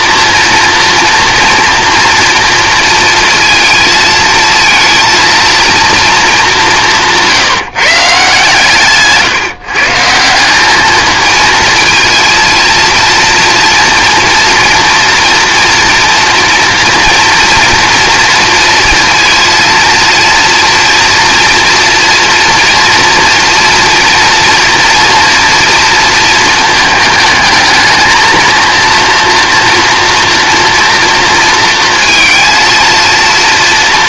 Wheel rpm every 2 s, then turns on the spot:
230, 230, 220, 190, 150, 200, 230, 230, 230, 230, 230, 230, 240, 220, 230, 240, 230.
8-10